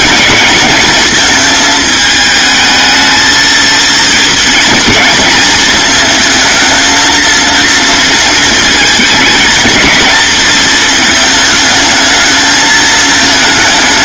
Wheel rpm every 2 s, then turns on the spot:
220, 220, 230, 230, 220, 220, 220.
none